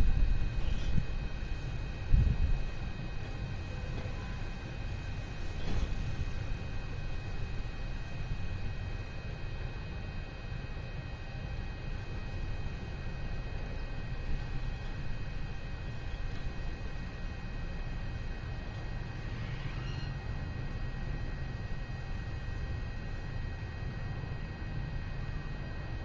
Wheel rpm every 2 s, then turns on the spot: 0, 0, 0, 0, 0, 0, 0, 0, 0, 0, 0, 0, 0.
none